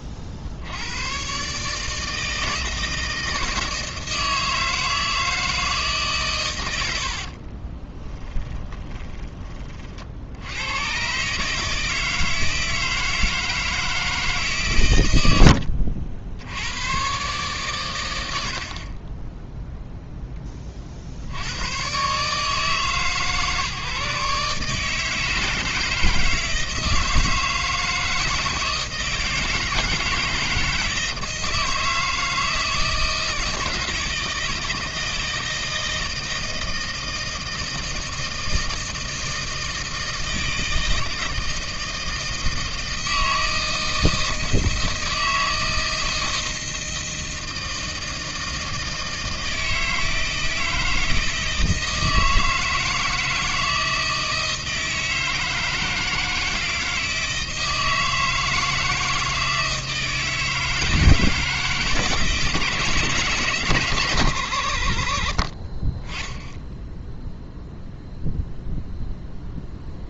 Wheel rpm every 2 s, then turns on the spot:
70, 160, 160, 110, 10, 90, 160, 140, 80, 70, 20, 150, 150, 160, 160, 160, 160, 160, 160, 160, 160, 160, 160, 160, 160, 160, 160, 160, 160, 160, 160, 150, 90, 10, 0.
8-10